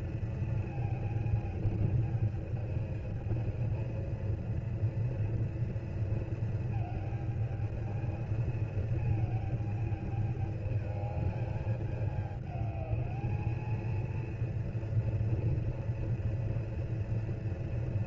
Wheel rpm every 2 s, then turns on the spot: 230, 220, 230, 220, 220, 220, 210, 230, 240.
none